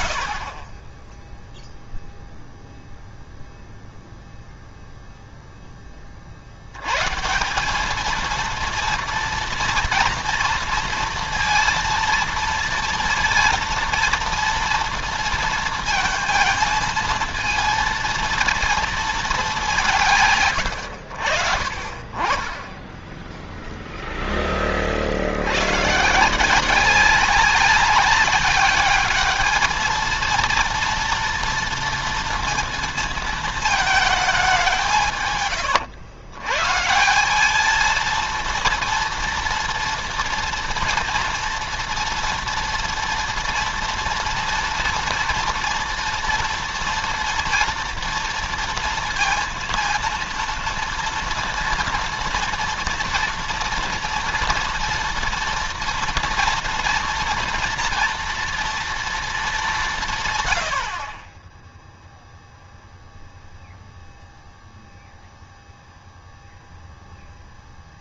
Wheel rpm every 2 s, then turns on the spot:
30, 0, 0, 100, 230, 230, 230, 230, 220, 230, 90, 20, 30, 180, 210, 230, 230, 170, 150, 230, 230, 230, 230, 240, 230, 230, 230, 230, 230, 230, 70, 0, 0, 0.
none